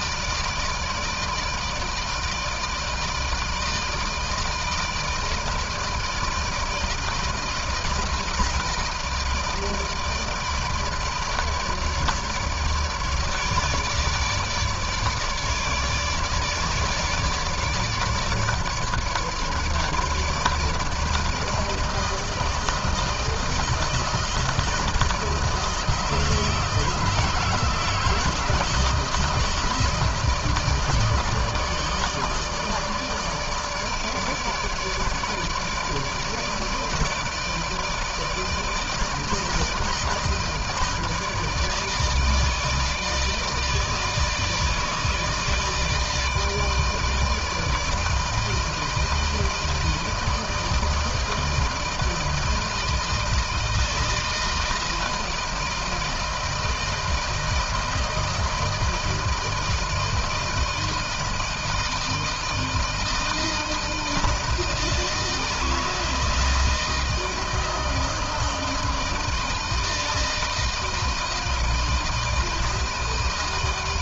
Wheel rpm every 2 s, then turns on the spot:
160, 160, 160, 160, 160, 150, 150, 150, 150, 150, 160, 160, 160, 160, 160, 150, 150, 150, 160, 160, 160, 160, 150, 160, 160, 160, 160, 160, 160, 160, 160, 160, 160, 160, 160, 160, 160.
none